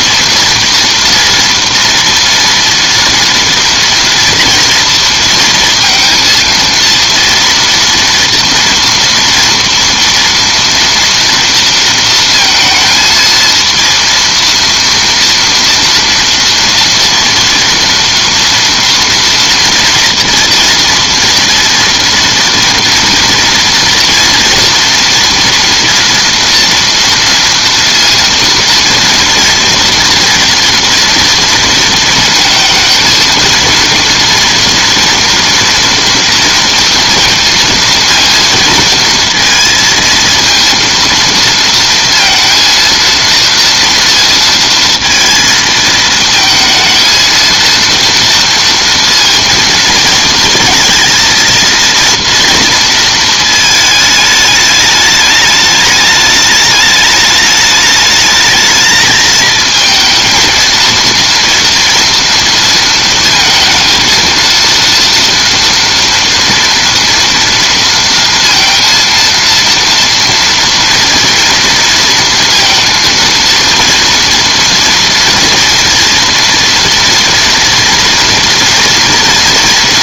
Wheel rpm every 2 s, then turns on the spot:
230, 230, 230, 230, 230, 230, 220, 230, 230, 230, 240, 240, 230, 230, 230, 230, 230, 230, 230, 230, 230, 230, 230, 220, 230, 220, 230, 210, 210, 220, 230, 230, 230, 230, 230, 230, 230, 230, 230, 230.
none